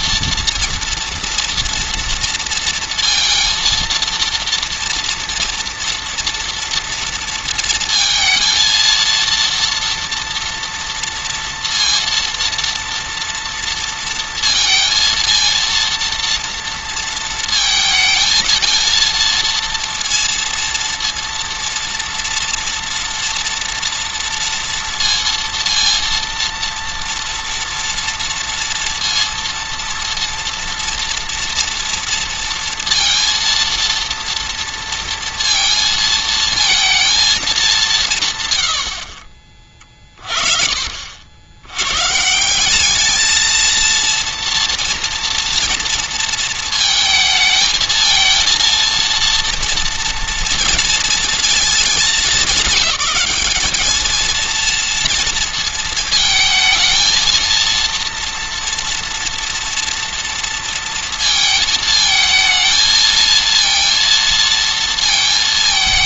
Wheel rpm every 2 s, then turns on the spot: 230, 230, 240, 230, 230, 240, 230, 230, 230, 230, 230, 230, 230, 230, 230, 230, 230, 230, 230, 90, 50, 200, 230, 220, 230, 230, 200, 230, 220, 230, 230, 220, 230.
none